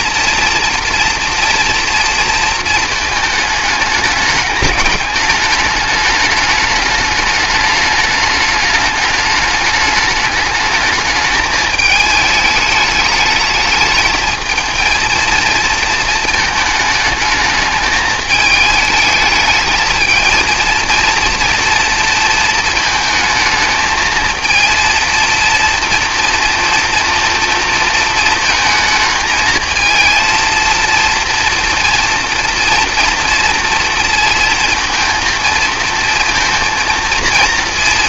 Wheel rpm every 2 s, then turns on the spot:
230, 230, 200, 200, 210, 220, 210, 220, 220, 220, 230, 220, 230, 230, 220, 230, 230, 230, 230.
none